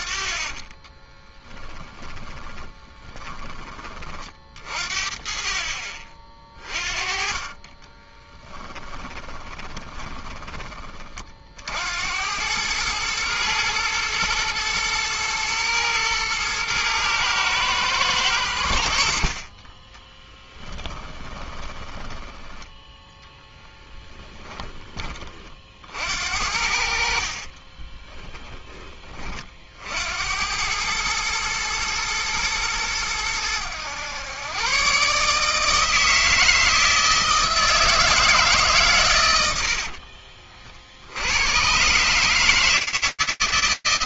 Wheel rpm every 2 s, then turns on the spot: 20, 30, 40, 40, 10, 20, 100, 110, 110, 90, 10, 10, 10, 60, 10, 90, 110, 120, 160, 150, 50, 160.
0-4 8-10 20-24